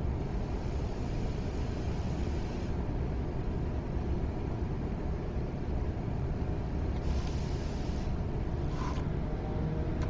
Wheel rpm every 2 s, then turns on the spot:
0, 0, 0, 0, 0.
none